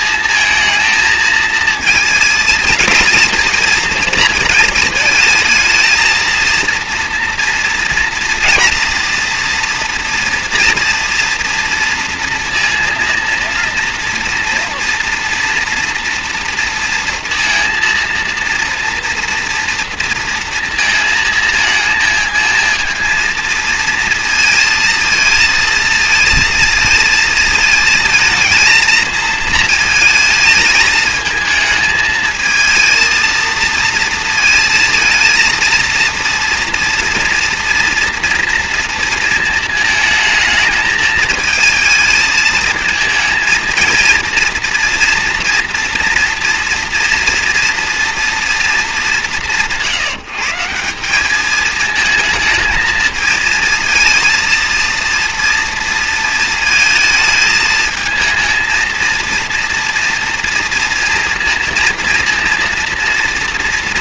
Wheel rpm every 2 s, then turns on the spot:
230, 220, 220, 230, 230, 230, 230, 230, 230, 230, 230, 230, 230, 220, 230, 220, 220, 230, 230, 230, 220, 220, 230, 240, 230, 170, 220, 230, 230, 230, 240, 230.
none